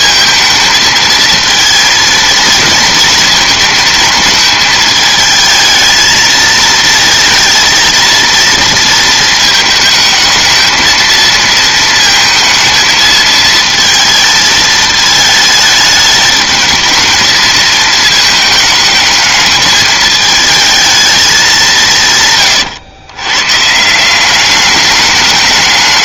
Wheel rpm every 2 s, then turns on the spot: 220, 230, 220, 220, 230, 230, 220, 220, 220, 220, 220, 120, 200.
none